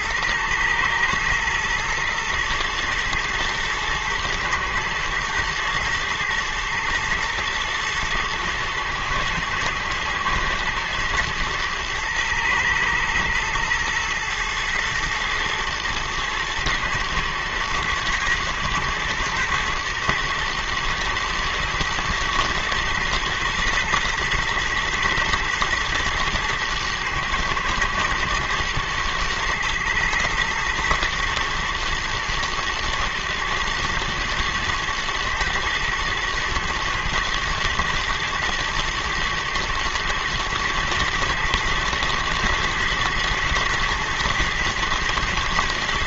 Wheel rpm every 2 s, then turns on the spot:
110, 120, 110, 110, 120, 120, 110, 110, 110, 120, 120, 120, 120, 120, 110, 110, 120, 110, 110, 110, 120, 110, 110.
none